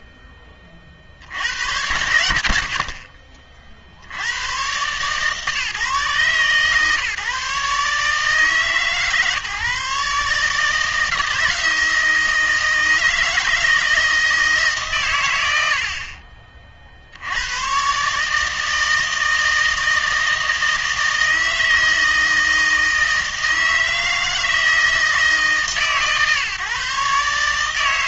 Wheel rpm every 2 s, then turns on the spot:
30, 70, 110, 140, 150, 150, 160, 150, 40, 160, 160, 160, 160, 140.
none